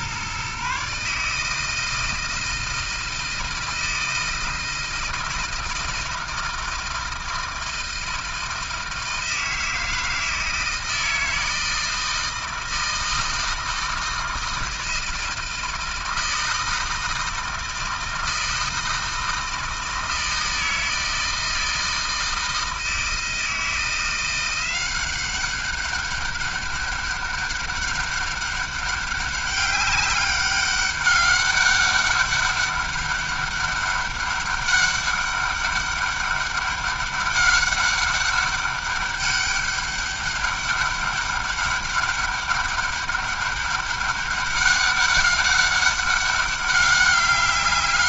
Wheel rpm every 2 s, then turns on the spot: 140, 160, 160, 160, 160, 160, 160, 160, 160, 160, 160, 160, 170, 200, 200, 200, 200, 200, 200, 200, 200, 200, 200, 200.
none